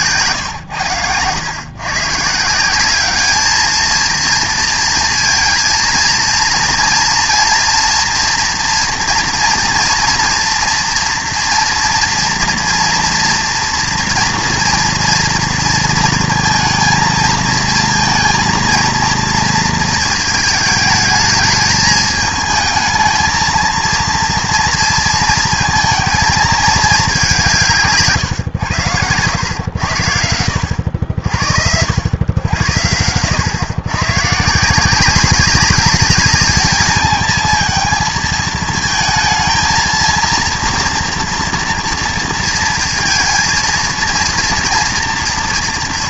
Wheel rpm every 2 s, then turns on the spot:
110, 170, 230, 230, 240, 230, 230, 230, 230, 230, 220, 220, 230, 210, 110, 80, 100, 170, 210, 220, 230, 230, 230.
28-30